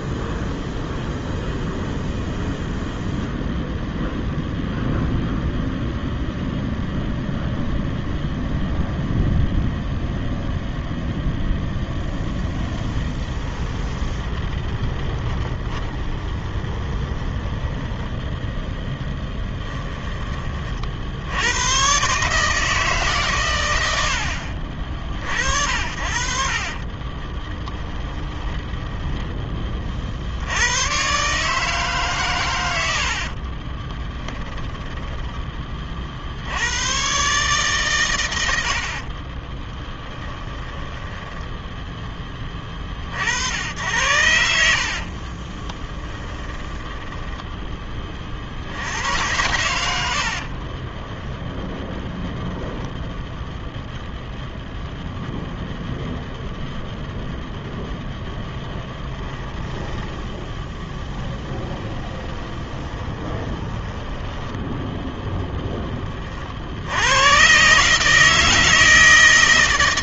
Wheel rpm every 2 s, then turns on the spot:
0, 0, 0, 0, 0, 0, 20, 20, 20, 10, 50, 150, 50, 40, 10, 110, 80, 20, 100, 60, 10, 50, 80, 10, 80, 30, 0, 0, 0, 10, 10, 20, 10, 70, 160.
12-18 26-30 34-36 38-42 44-48 50-52 58-64